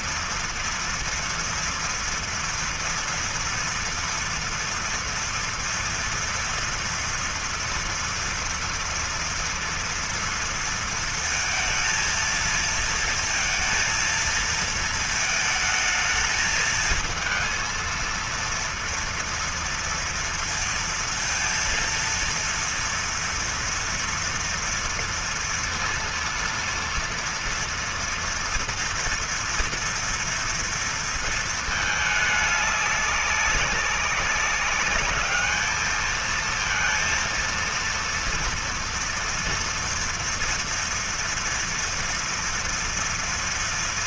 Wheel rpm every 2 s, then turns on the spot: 230, 240, 230, 230, 230, 230, 230, 230, 220, 230, 230, 230, 230, 230, 230, 230, 210, 200, 220, 230, 230, 230.
none